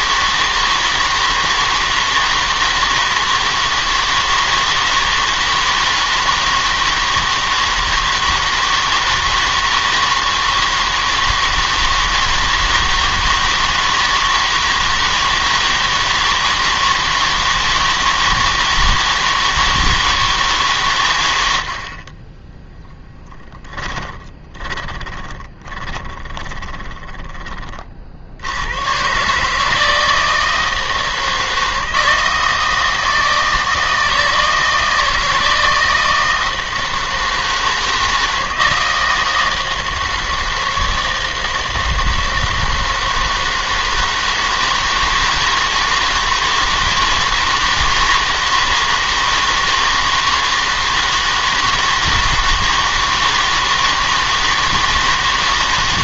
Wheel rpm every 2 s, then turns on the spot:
160, 160, 160, 160, 160, 160, 160, 160, 160, 160, 140, 10, 20, 30, 100, 160, 160, 160, 160, 160, 160, 160, 160, 160, 160, 160, 160, 160.
24-28